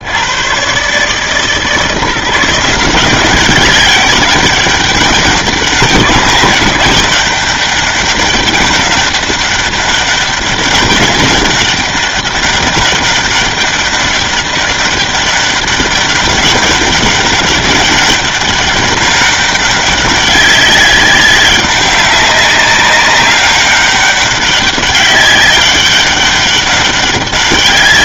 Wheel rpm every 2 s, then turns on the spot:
130, 170, 200, 190, 200, 200, 200, 200, 200, 200, 200, 200, 200, 200.
none